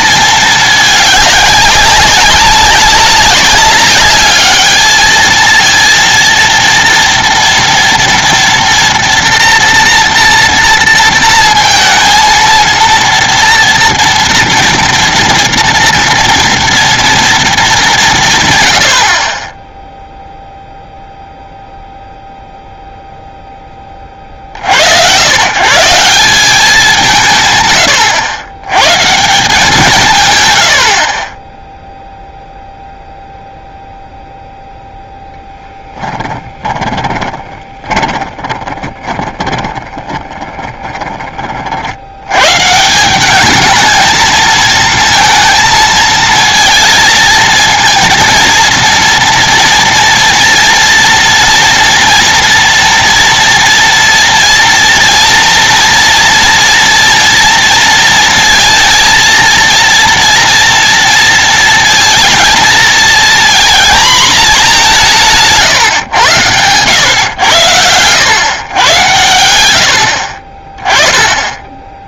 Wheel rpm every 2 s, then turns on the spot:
220, 190, 210, 230, 230, 230, 230, 240, 230, 120, 0, 0, 60, 180, 110, 100, 0, 0, 10, 20, 20, 140, 220, 230, 230, 240, 230, 230, 230, 230, 230, 230, 210, 110, 120, 30.
36-42